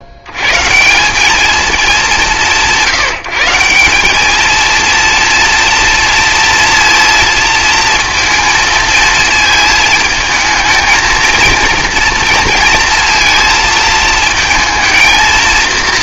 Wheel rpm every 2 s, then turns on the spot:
130, 160, 230, 230, 230, 230, 230, 230.
none